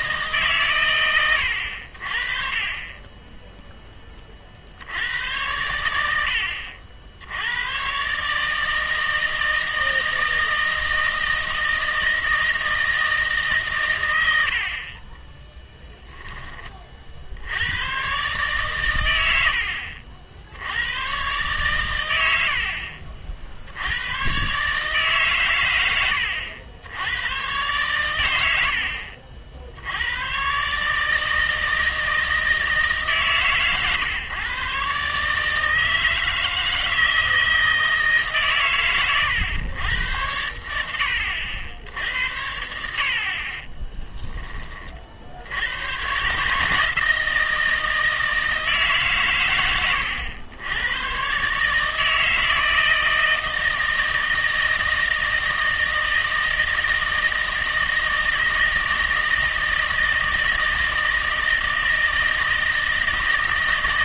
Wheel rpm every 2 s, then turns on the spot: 130, 30, 70, 60, 160, 160, 160, 50, 40, 110, 90, 60, 140, 80, 60, 140, 160, 140, 160, 130, 80, 70, 40, 150, 150, 100, 160, 160, 160, 160, 160, 160.
42-44